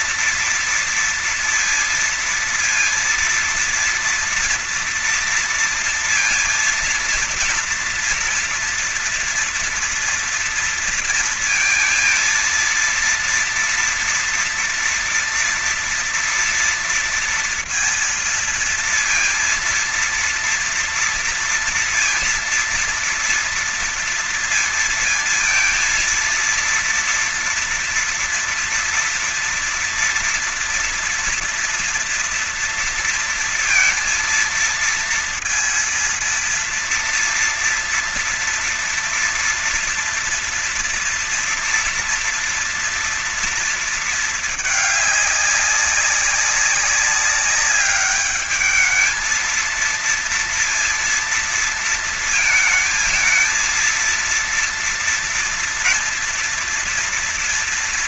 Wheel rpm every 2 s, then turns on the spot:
230, 230, 230, 230, 230, 230, 230, 230, 230, 230, 230, 230, 230, 230, 230, 230, 230, 230, 230, 230, 230, 240, 220, 200, 210, 230, 220, 230, 230.
none